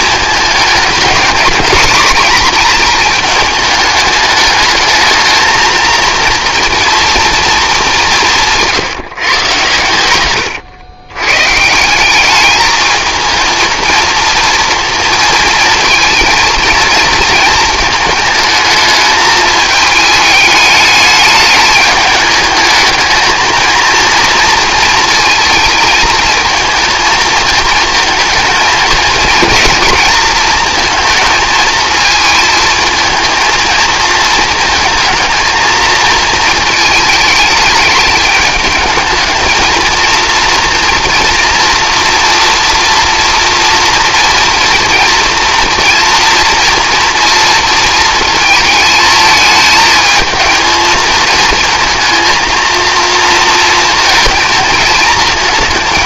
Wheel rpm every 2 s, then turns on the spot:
220, 230, 210, 230, 170, 120, 210, 230, 230, 220, 210, 210, 230, 230, 220, 230, 220, 220, 220, 210, 240, 230, 230, 230, 220, 220, 230, 220.
none